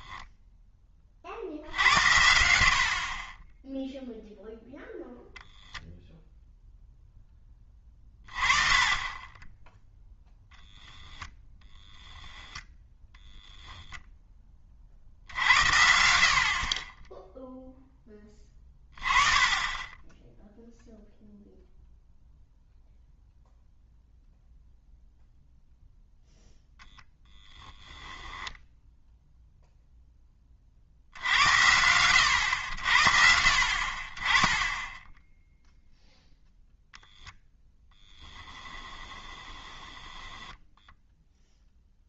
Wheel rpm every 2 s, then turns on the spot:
10, 60, 0, 0, 30, 0, 0, 30, 30, 30, 0, 0, 0, 0, 10, 50, 70, 10, 0, 10, 10.
38-42